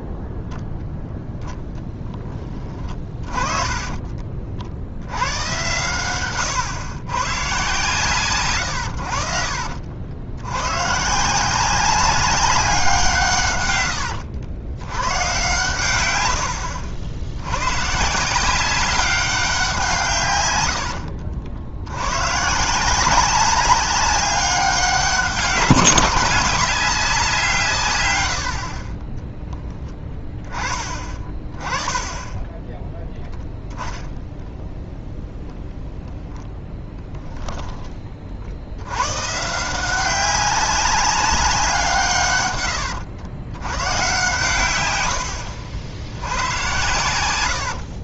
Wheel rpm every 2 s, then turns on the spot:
0, 20, 70, 120, 100, 110, 190, 100, 60, 190, 90, 170, 190, 190, 40, 20, 10, 0, 10, 70, 190, 110, 120, 100.
2-4 36-38 42-44